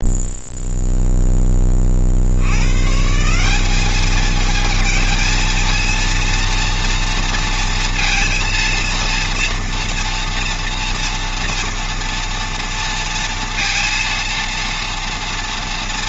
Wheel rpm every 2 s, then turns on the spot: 0, 100, 220, 230, 230, 230, 230, 230.
none